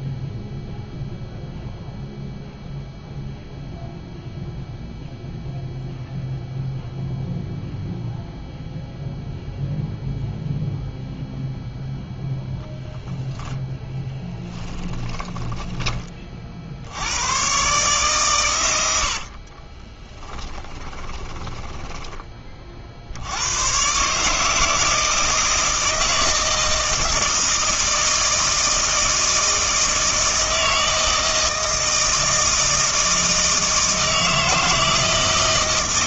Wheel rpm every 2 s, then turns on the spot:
0, 0, 0, 0, 0, 0, 0, 10, 60, 100, 10, 50, 160, 160, 160, 160, 160, 160.
14-16 20-22